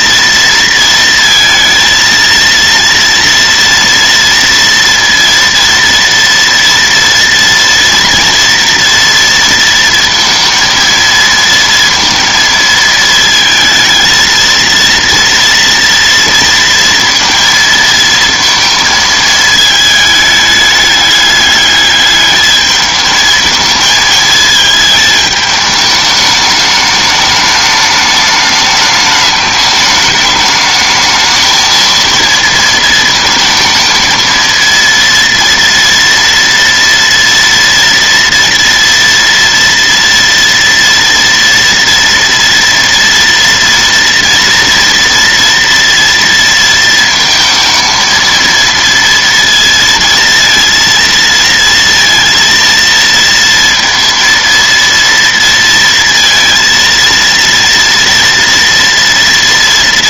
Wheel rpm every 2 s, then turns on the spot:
230, 230, 230, 230, 230, 230, 220, 230, 230, 230, 210, 210, 220, 210, 210, 210, 230, 230, 230, 230, 230, 230, 230, 230, 230, 230, 230, 230, 230, 230.
none